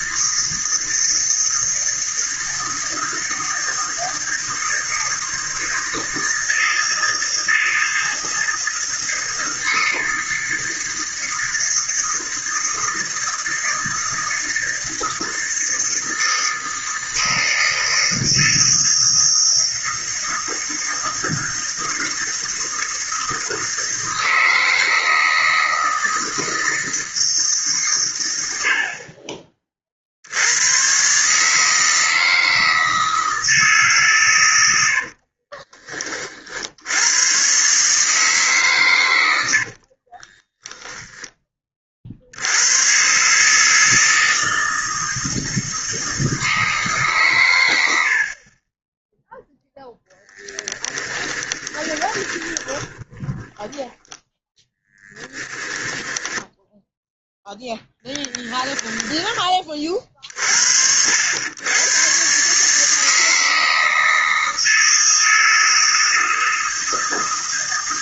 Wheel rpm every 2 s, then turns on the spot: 160, 160, 160, 160, 160, 160, 160, 160, 160, 160, 160, 160, 160, 160, 50, 120, 160, 80, 80, 120, 10, 110, 160, 150, 20, 10, 10, 10, 0, 10, 70, 150, 160, 160.
34-36 50-54